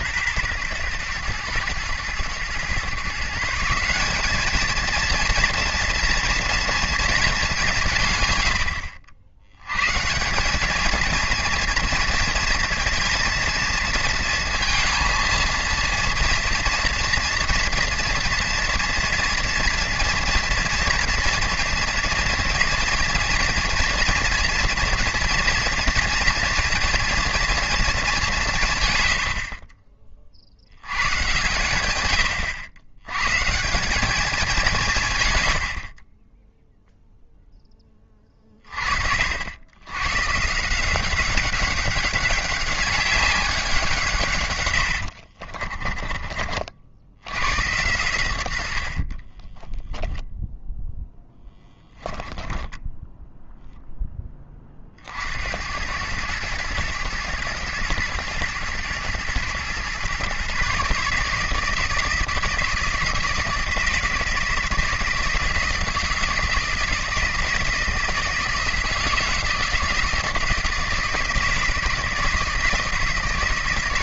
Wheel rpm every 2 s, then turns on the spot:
110, 130, 220, 230, 80, 210, 230, 230, 240, 230, 230, 230, 230, 230, 130, 90, 100, 180, 0, 30, 160, 200, 100, 60, 80, 0, 10, 40, 110, 110, 140, 160, 160, 160, 160, 160, 160.
44-46 52-54